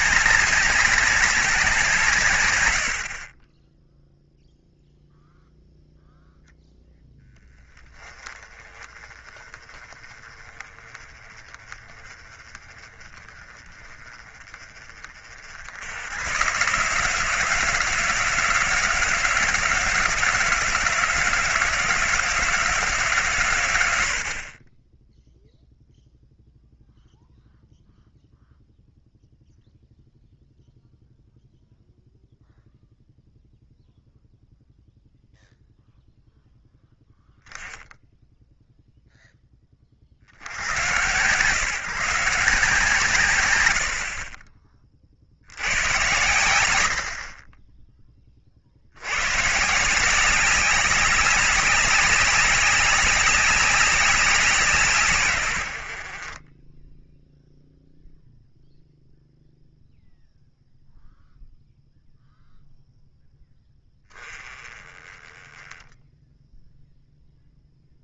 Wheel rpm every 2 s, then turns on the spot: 200, 70, 0, 10, 30, 30, 30, 40, 140, 170, 160, 160, 20, 0, 0, 0, 0, 0, 0, 0, 100, 150, 40, 70, 70, 200, 190, 160, 20, 0, 0, 0, 20, 0.
none